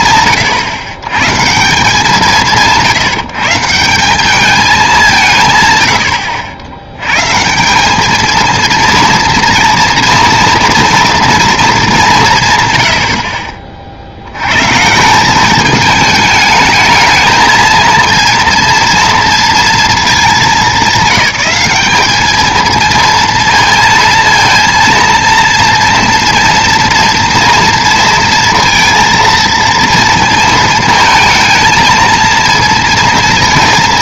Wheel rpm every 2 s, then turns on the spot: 120, 160, 210, 90, 230, 230, 130, 130, 220, 230, 210, 220, 230, 230, 230, 230, 230.
none